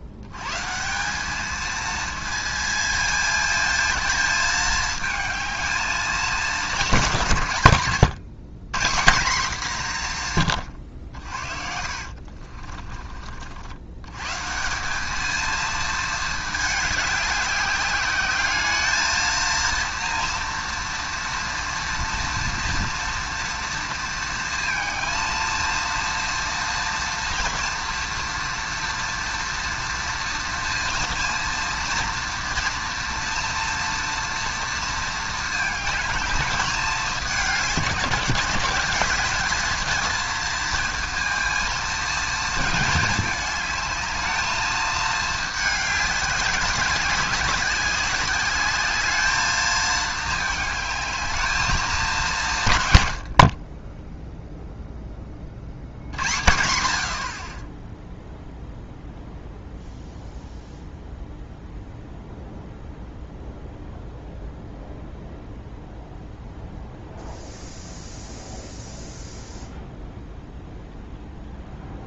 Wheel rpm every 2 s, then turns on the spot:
150, 220, 220, 190, 160, 100, 30, 170, 210, 210, 230, 230, 230, 230, 230, 230, 230, 230, 210, 180, 230, 220, 220, 190, 200, 210, 130, 0, 70, 0, 0, 0, 0, 0, 0, 0.
12-14